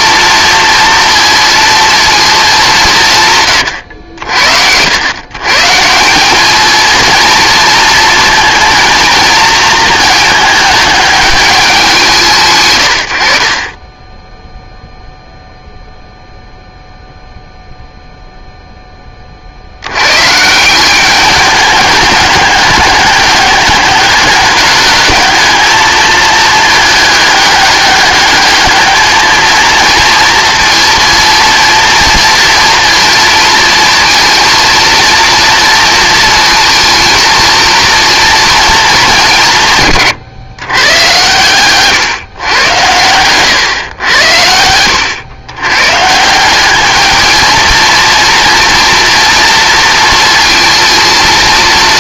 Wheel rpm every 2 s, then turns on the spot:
230, 190, 90, 230, 230, 220, 110, 0, 0, 10, 180, 210, 210, 210, 210, 230, 230, 230, 230, 210, 120, 120, 100, 210, 230, 230.
none